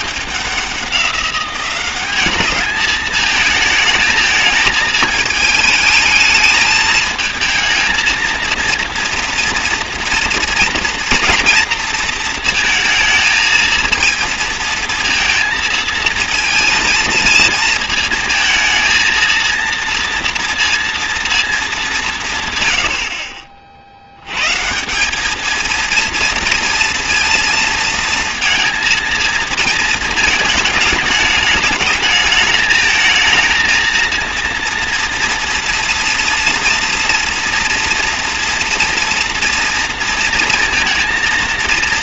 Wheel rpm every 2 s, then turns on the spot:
190, 220, 220, 220, 230, 230, 220, 230, 220, 220, 230, 90, 190, 230, 230, 210, 220, 230, 230, 230, 230.
none